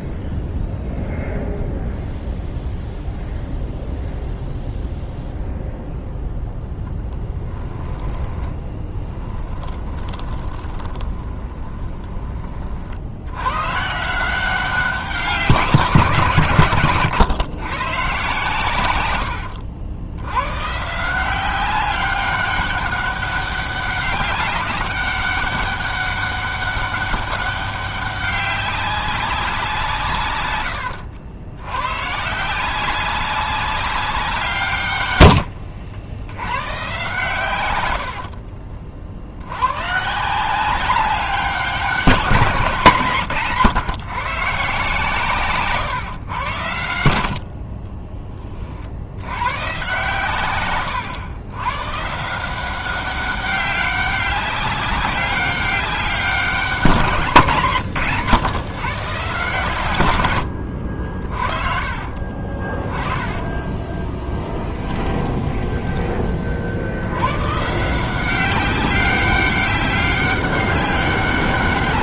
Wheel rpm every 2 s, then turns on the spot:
0, 0, 0, 0, 10, 30, 40, 180, 150, 110, 140, 200, 200, 200, 200, 90, 180, 160, 110, 50, 190, 170, 140, 100, 30, 120, 180, 200, 190, 130, 80, 30, 20, 60, 190, 190.
8-12 38-40 62-66